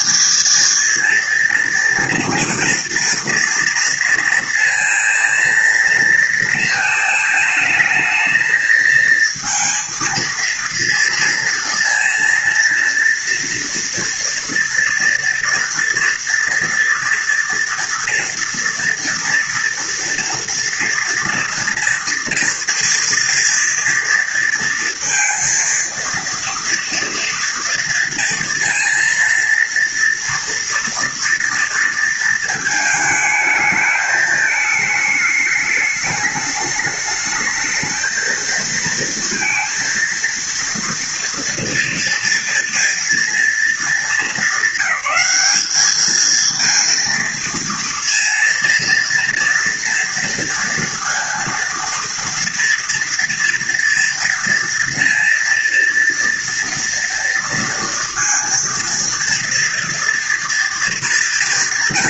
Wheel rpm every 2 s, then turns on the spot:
220, 230, 230, 230, 220, 230, 230, 230, 230, 230, 230, 230, 230, 230, 230, 230, 220, 220, 210, 230, 230, 230, 210, 230, 230, 230, 230, 230, 230, 230, 230.
none